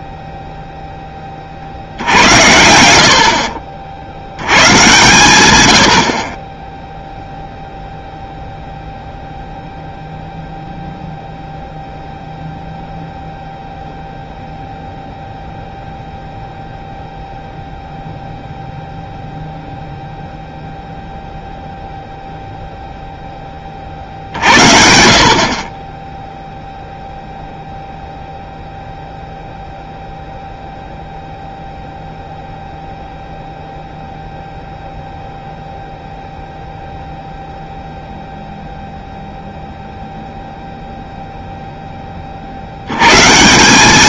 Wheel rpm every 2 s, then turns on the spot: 0, 80, 120, 10, 0, 0, 0, 0, 0, 0, 0, 0, 60, 0, 0, 0, 0, 0, 0, 0, 0, 70.
none